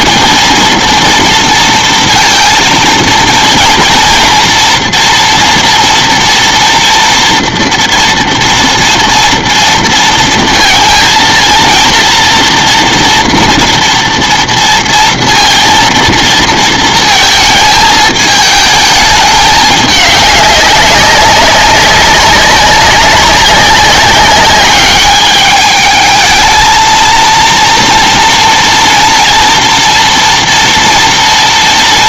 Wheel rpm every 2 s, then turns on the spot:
230, 230, 230, 230, 230, 230, 230, 230, 230, 220, 200, 190, 200, 220, 230, 230.
none